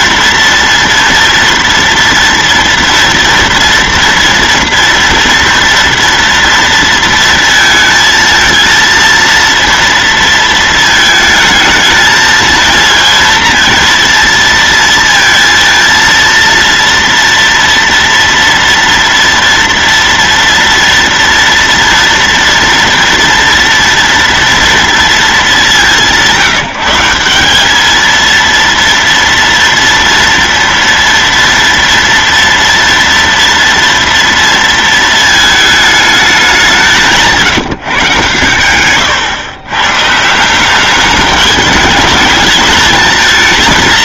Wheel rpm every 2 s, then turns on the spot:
230, 230, 230, 230, 230, 230, 220, 230, 230, 230, 230, 230, 230, 180, 230, 230, 230, 230, 190, 110, 180, 220.
38-40